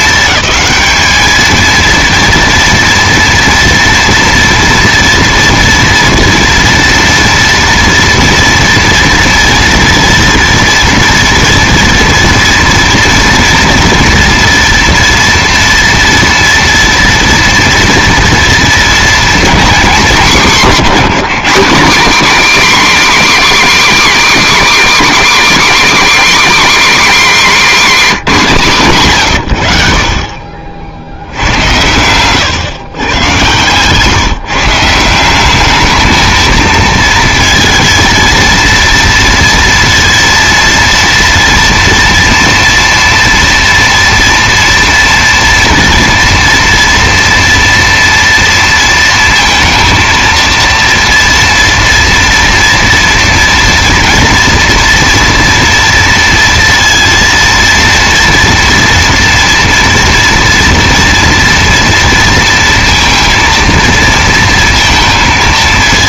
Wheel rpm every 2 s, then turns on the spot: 220, 230, 230, 230, 230, 230, 230, 230, 230, 230, 210, 290, 300, 290, 180, 70, 110, 170, 230, 230, 230, 230, 230, 230, 230, 230, 230, 230, 230, 230, 230, 230, 230.
none